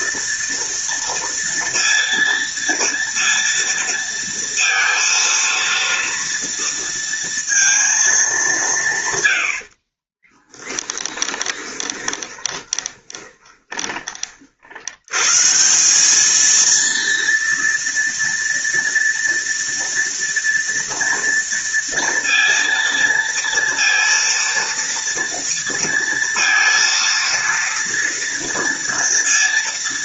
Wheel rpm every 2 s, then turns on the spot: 230, 230, 230, 230, 140, 20, 20, 110, 230, 230, 230, 230, 230, 230, 220.
10-14